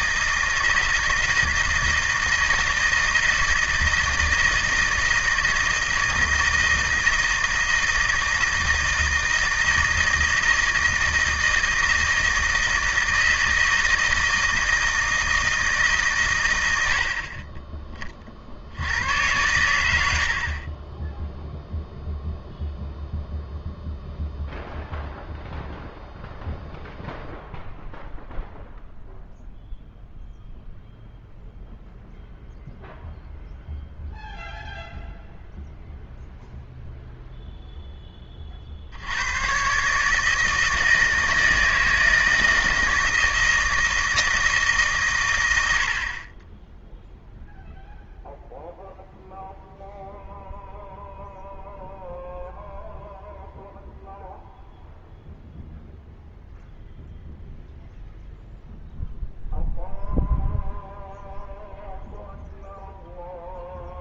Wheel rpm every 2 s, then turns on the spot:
160, 160, 160, 160, 160, 160, 160, 160, 90, 80, 40, 0, 0, 0, 0, 0, 0, 0, 0, 50, 160, 160, 150, 10, 0, 0, 0, 0, 0, 0, 0, 0.
none